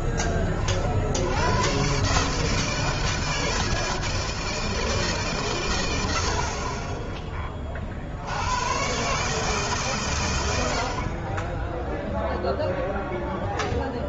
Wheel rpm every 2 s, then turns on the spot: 40, 150, 160, 60, 80, 80, 0.
none